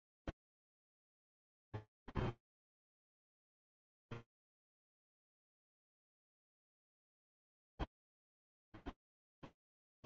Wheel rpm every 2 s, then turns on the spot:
0, 0, 40, 20, 0.
none